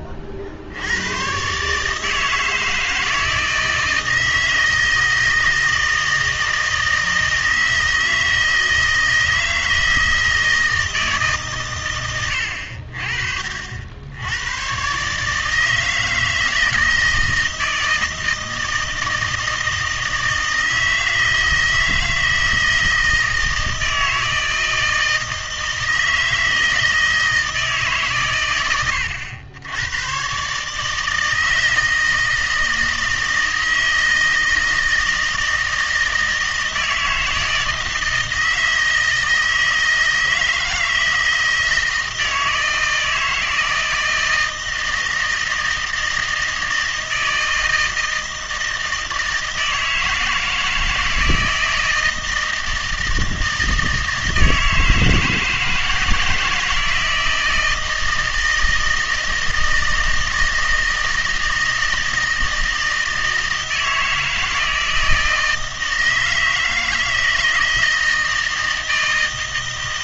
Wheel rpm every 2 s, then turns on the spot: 80, 160, 160, 160, 160, 160, 70, 120, 160, 160, 160, 160, 160, 160, 110, 150, 160, 160, 160, 160, 160, 160, 160, 160, 160, 160, 160, 160, 160, 160, 160, 160, 160, 160, 160.
none